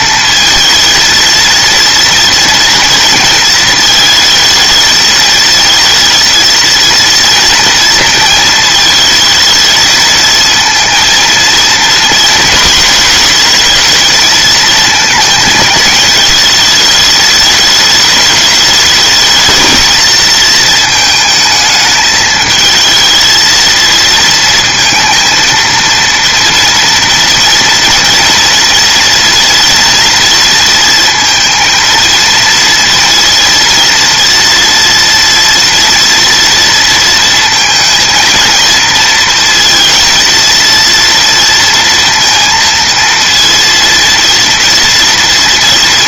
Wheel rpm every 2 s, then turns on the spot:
220, 230, 220, 230, 220, 230, 230, 220, 210, 210, 220, 220, 230, 240, 230, 230, 230, 230, 230, 230, 230, 230, 240.
none